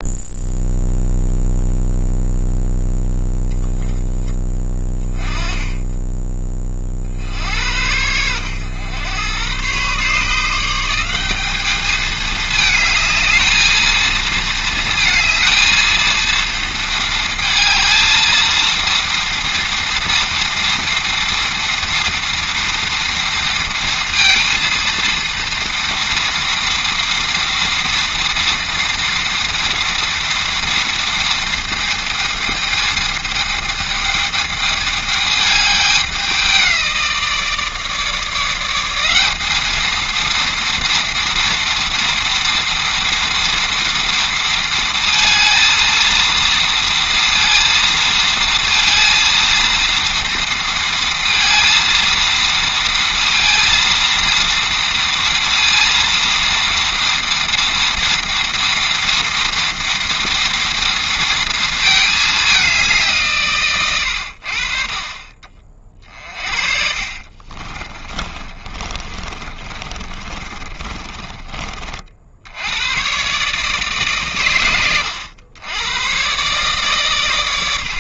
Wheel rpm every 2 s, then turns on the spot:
0, 0, 20, 40, 100, 180, 220, 230, 220, 230, 230, 230, 230, 230, 230, 230, 220, 210, 170, 180, 230, 230, 230, 230, 230, 230, 230, 230, 230, 230, 230, 180, 40, 50, 30, 30, 110, 100, 130.
66-72